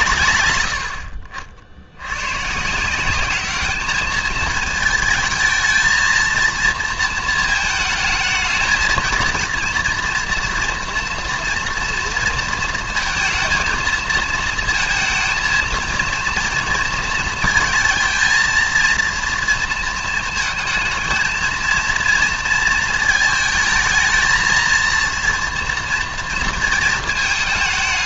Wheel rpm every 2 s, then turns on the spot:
100, 180, 220, 230, 220, 230, 230, 220, 230, 230, 220, 220, 230, 230.
none